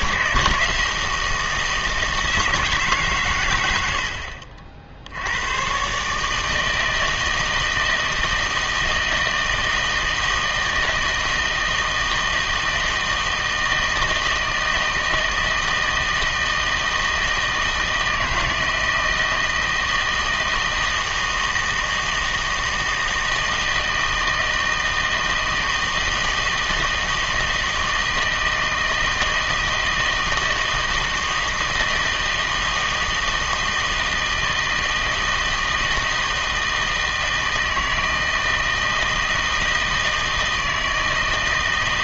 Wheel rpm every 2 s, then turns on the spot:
160, 160, 50, 150, 160, 160, 160, 160, 160, 160, 160, 160, 160, 160, 160, 160, 160, 160, 160, 160, 160.
none